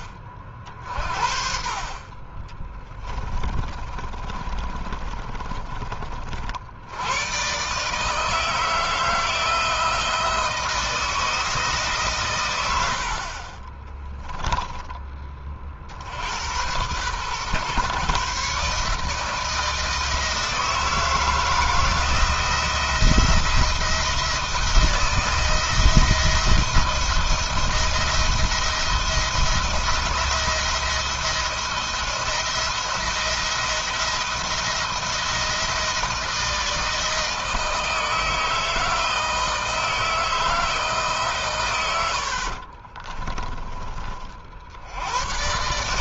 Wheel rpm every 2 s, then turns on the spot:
50, 20, 30, 100, 160, 160, 70, 20, 120, 150, 160, 170, 170, 170, 170, 170, 170, 170, 160, 160, 150, 40, 80.
2-6 42-44